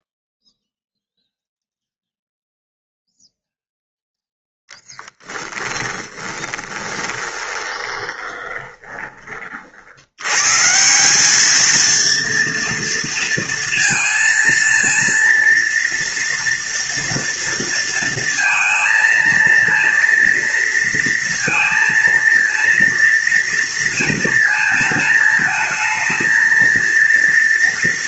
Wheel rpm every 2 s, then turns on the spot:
0, 0, 10, 10, 20, 160, 230, 230, 230, 230, 230, 230, 220, 230.
4-10